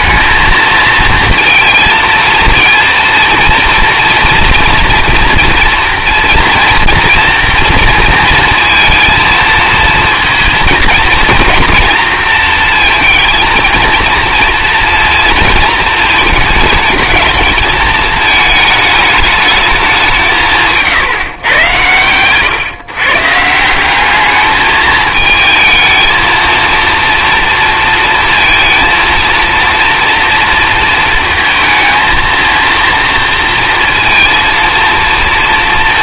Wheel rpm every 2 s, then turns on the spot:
220, 230, 230, 230, 230, 230, 230, 230, 220, 220, 150, 130, 220, 230, 230, 230, 230, 230.
none